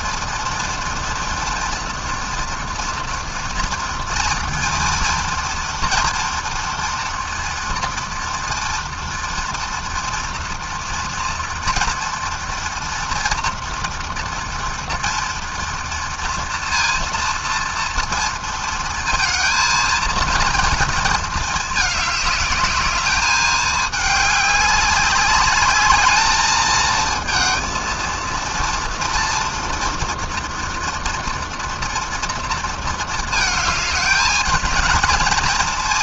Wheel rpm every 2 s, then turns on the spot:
230, 230, 230, 230, 240, 230, 230, 230, 230, 230, 220, 210, 200, 220, 230, 230, 220, 230.
none